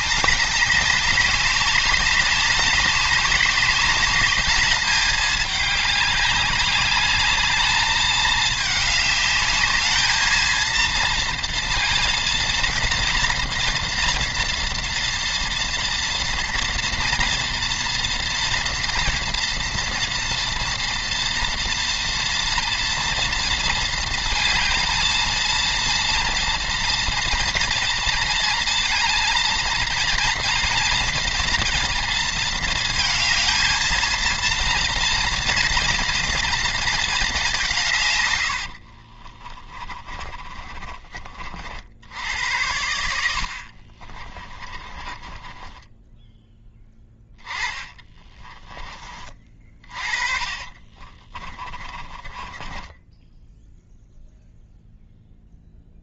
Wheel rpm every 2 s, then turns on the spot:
200, 200, 210, 200, 220, 230, 230, 230, 230, 230, 230, 230, 230, 230, 230, 230, 230, 230, 230, 60, 30, 90, 30, 10, 30, 30, 20, 0.
38-42 44-46 48-54